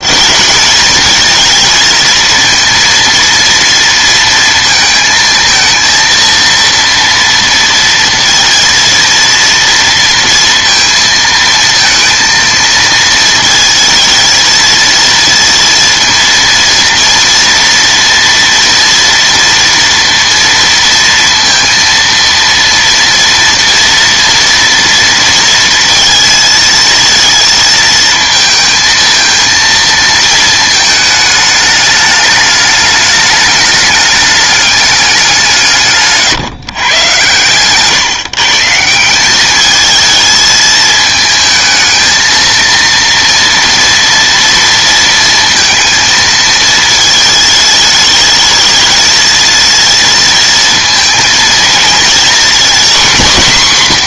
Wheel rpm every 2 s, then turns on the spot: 220, 230, 230, 230, 230, 230, 230, 230, 230, 240, 230, 230, 230, 220, 230, 220, 210, 200, 130, 160, 220, 230, 230, 220, 220, 230, 240.
none